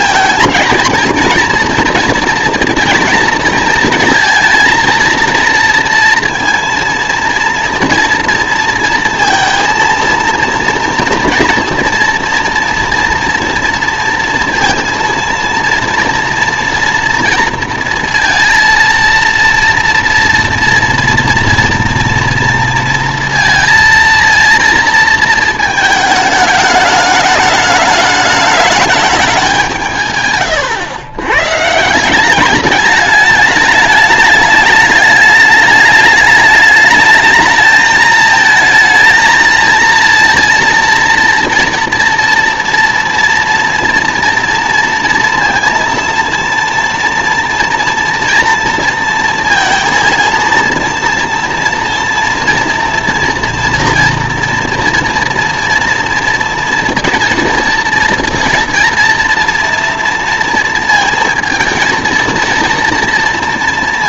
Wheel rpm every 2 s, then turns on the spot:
230, 230, 230, 230, 230, 230, 230, 230, 230, 230, 230, 230, 230, 210, 210, 120, 200, 210, 210, 220, 230, 230, 230, 230, 230, 230, 230, 240, 230, 230, 230, 230.
none